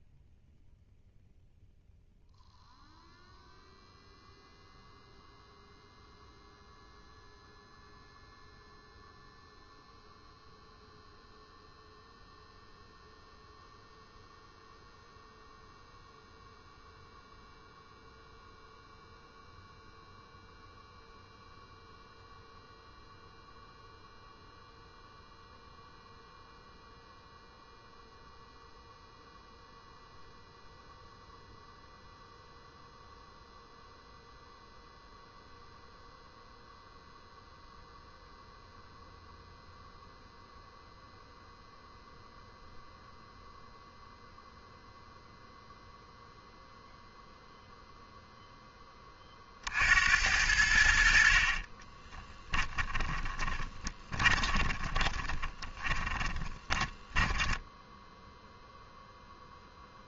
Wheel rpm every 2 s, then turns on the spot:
0, 0, 0, 0, 0, 0, 0, 0, 0, 0, 0, 0, 0, 0, 0, 0, 0, 0, 0, 0, 0, 0, 0, 0, 20, 80, 30, 20, 20, 0.
52-58